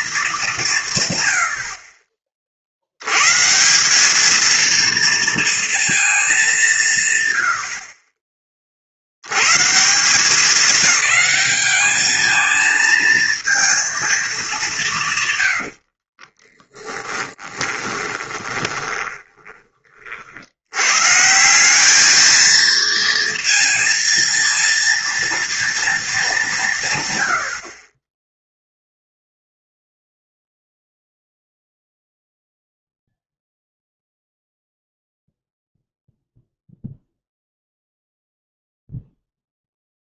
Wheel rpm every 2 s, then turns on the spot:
180, 60, 220, 190, 30, 210, 220, 190, 20, 20, 90, 230, 230, 170, 0, 0, 0, 0, 0, 0.
16-20